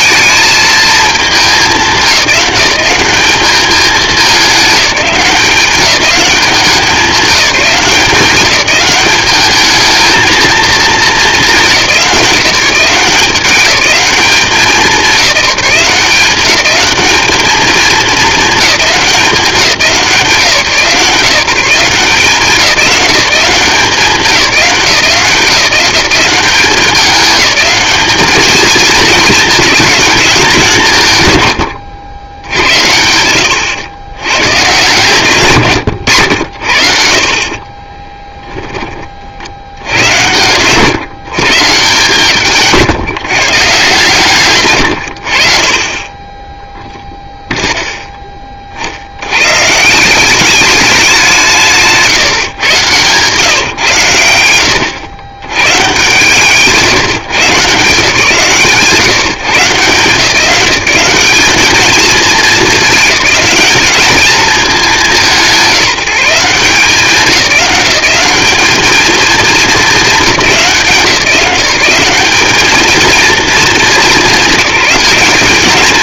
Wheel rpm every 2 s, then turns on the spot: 220, 190, 200, 190, 190, 220, 180, 190, 210, 190, 160, 170, 170, 200, 220, 150, 90, 140, 60, 20, 140, 160, 100, 0, 60, 200, 120, 100, 150, 140, 190, 210, 200, 170, 210, 180, 220, 200.
42-44